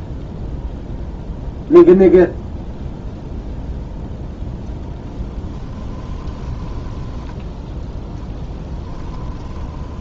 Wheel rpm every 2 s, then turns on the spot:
0, 0, 0, 10, 10.
6-10